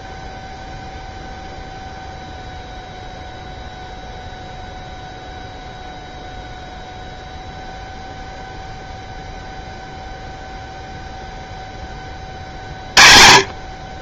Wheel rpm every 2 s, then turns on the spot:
0, 0, 0, 0, 0, 0, 40.
none